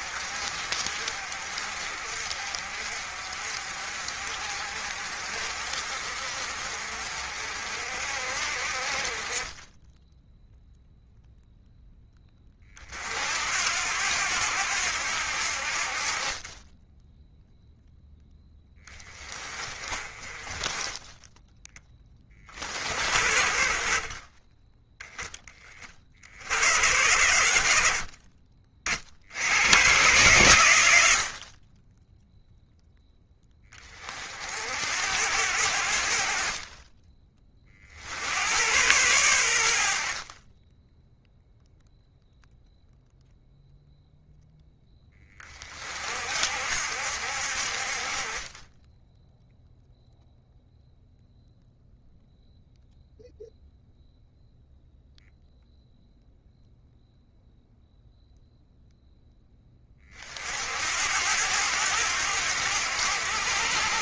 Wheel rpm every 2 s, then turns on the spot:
50, 50, 50, 50, 40, 0, 40, 80, 10, 20, 20, 60, 10, 100, 60, 70, 10, 70, 30, 110, 10, 0, 10, 70, 10, 0, 0, 0, 0, 0, 70, 80.
36-38